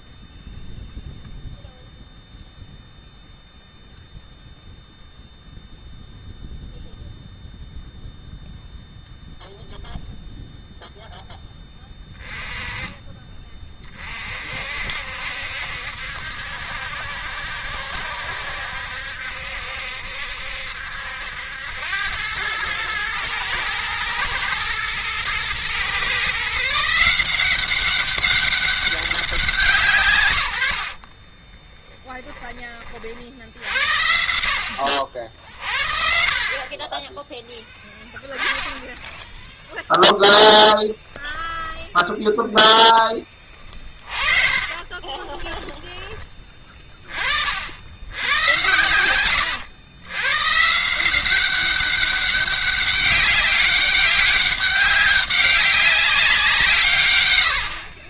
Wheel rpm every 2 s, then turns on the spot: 0, 0, 0, 0, 0, 0, 20, 60, 70, 70, 70, 110, 120, 160, 190, 70, 30, 80, 40, 10, 10, 10, 40, 30, 100, 150, 200, 200, 160.
34-36 40-42 44-46